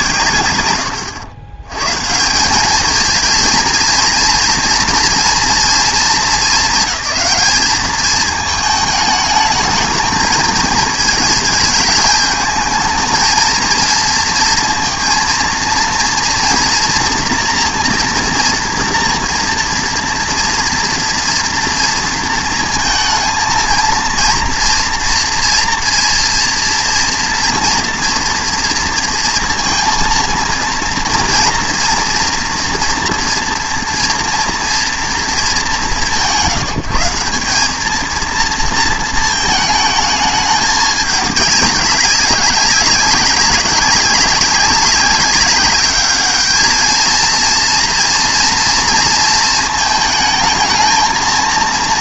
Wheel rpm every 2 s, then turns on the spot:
90, 190, 240, 200, 220, 220, 220, 230, 230, 230, 230, 230, 230, 230, 230, 230, 240, 230, 160, 230, 210, 200, 200, 220, 230, 220.
none